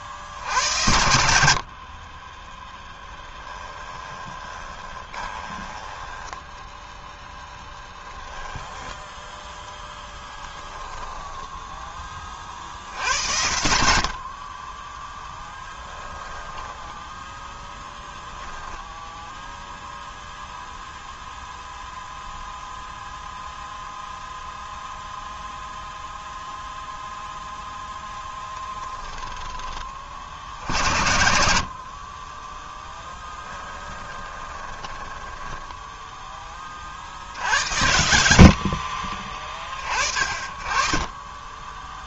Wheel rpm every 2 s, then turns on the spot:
80, 10, 20, 0, 0, 10, 60, 20, 10, 0, 0, 0, 0, 0, 10, 70, 10, 10, 40, 40, 30.
2-6 10-12 16-18 28-30 32-36 38-40